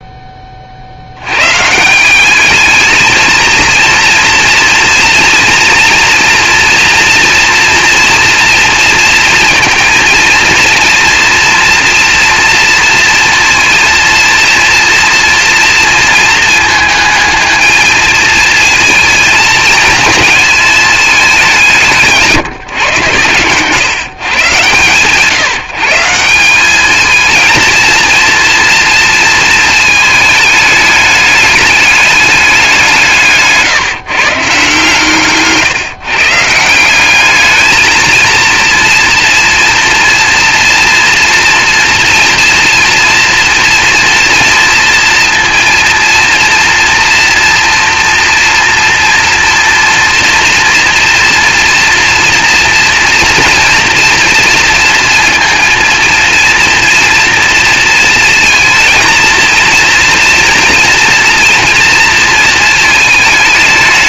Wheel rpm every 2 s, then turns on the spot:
40, 210, 230, 230, 230, 230, 230, 230, 220, 220, 210, 130, 140, 200, 230, 210, 180, 150, 170, 230, 240, 240, 230, 230, 230, 230, 230, 230, 230, 220, 230, 220.
none